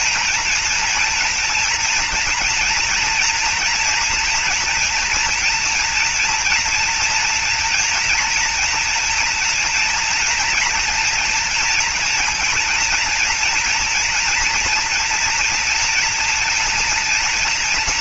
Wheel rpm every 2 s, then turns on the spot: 230, 230, 230, 230, 230, 230, 240, 230, 230.
none